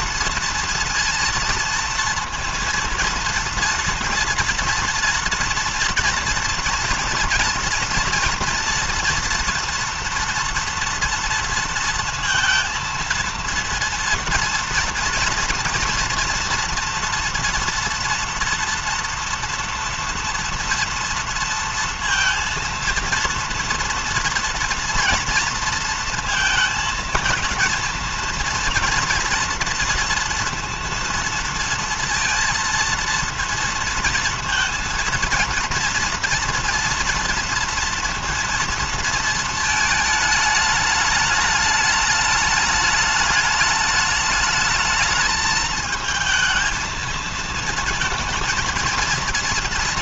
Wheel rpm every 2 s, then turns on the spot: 230, 230, 230, 230, 230, 230, 230, 230, 230, 230, 230, 230, 230, 220, 230, 230, 230, 230, 230, 230, 210, 210, 220, 220, 230.
none